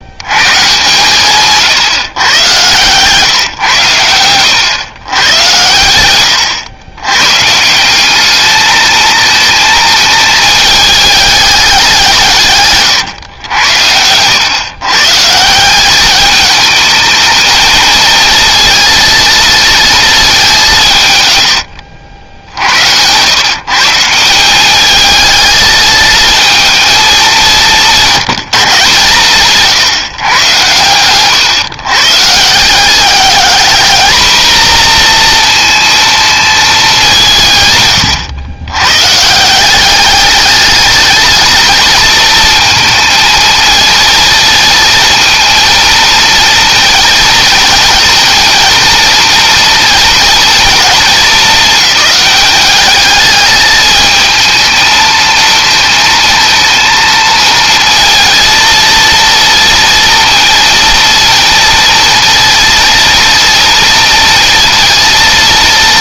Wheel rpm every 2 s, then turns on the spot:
140, 130, 120, 120, 220, 210, 130, 140, 220, 230, 130, 90, 210, 220, 150, 120, 200, 240, 190, 130, 220, 230, 230, 230, 230, 220, 210, 220, 230, 230, 230, 230, 230.
0-2 20-22